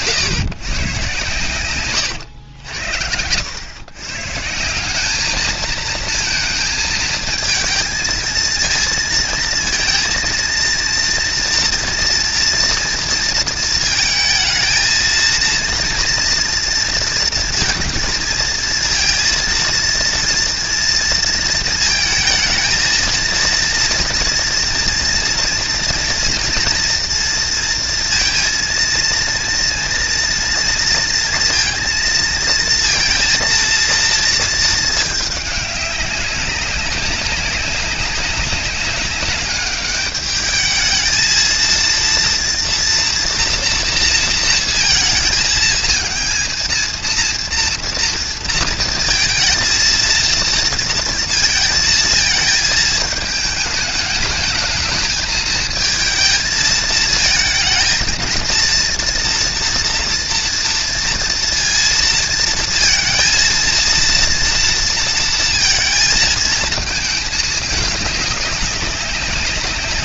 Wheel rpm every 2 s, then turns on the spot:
140, 100, 160, 230, 230, 230, 230, 230, 230, 230, 230, 220, 240, 230, 230, 230, 230, 230, 190, 200, 210, 230, 230, 230, 230, 230, 220, 210, 220, 230, 230, 230, 230, 220, 200.
none